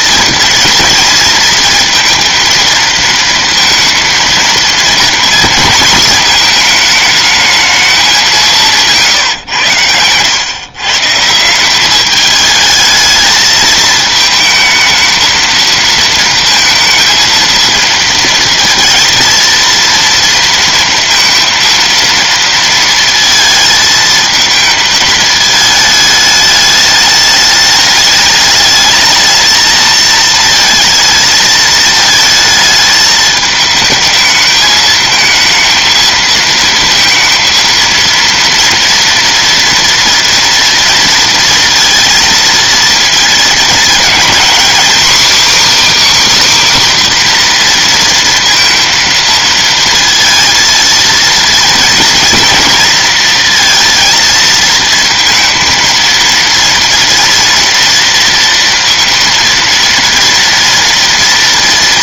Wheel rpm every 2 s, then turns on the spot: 230, 230, 230, 220, 110, 180, 220, 230, 230, 230, 230, 220, 220, 210, 220, 220, 220, 220, 230, 230, 230, 220, 300, 240, 230, 230, 230, 230, 230, 230, 230.
none